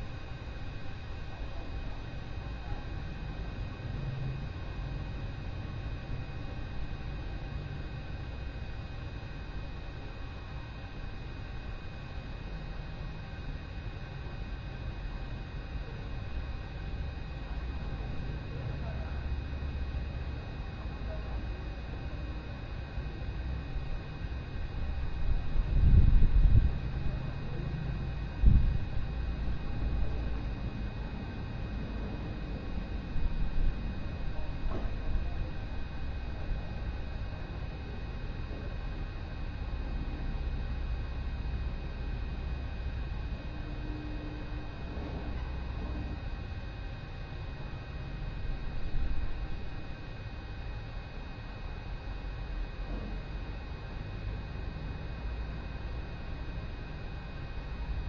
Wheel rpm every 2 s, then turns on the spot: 0, 0, 0, 0, 0, 0, 0, 0, 0, 0, 0, 0, 0, 0, 0, 0, 0, 0, 0, 0, 0, 0, 0, 0, 0, 0, 0, 0, 0.
none